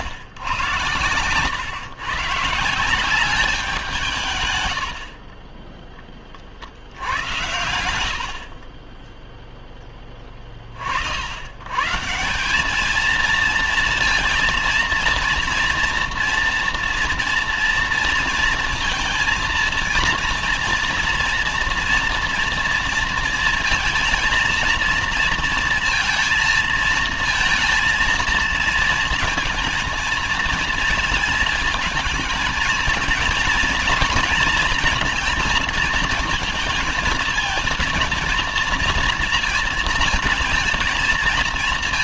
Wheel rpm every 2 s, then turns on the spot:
110, 150, 110, 60, 50, 40, 190, 230, 230, 230, 230, 230, 230, 230, 230, 220, 220, 230, 220, 230, 220.
none